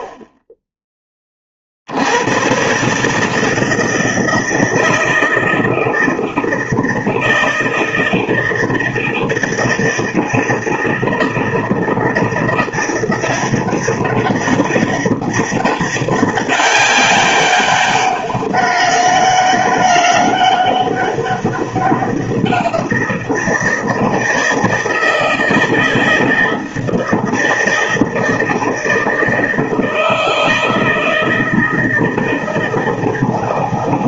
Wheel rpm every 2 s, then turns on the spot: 10, 130, 160, 160, 160, 160, 170, 200, 200, 200, 200, 180, 160, 160, 160, 160, 160.
none